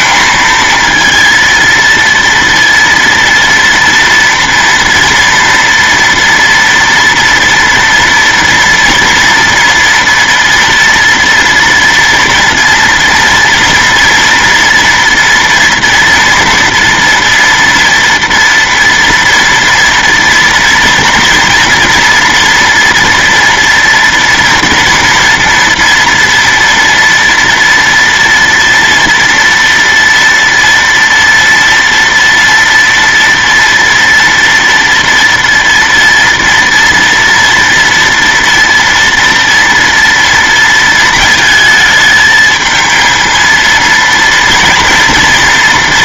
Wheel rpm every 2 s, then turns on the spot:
230, 230, 230, 230, 240, 230, 230, 230, 230, 230, 230, 230, 230, 230, 230, 230, 230, 230, 230, 240, 230, 220, 230.
none